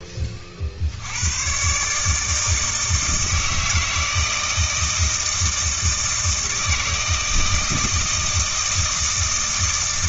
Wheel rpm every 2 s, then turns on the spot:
60, 160, 160, 160, 160.
none